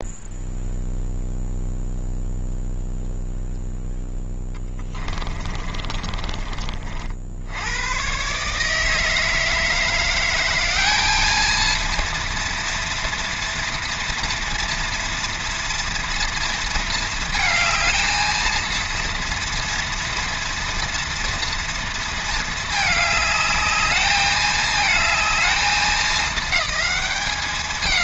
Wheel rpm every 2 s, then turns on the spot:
0, 0, 20, 50, 160, 210, 230, 230, 220, 230, 240, 220, 220, 200.
4-6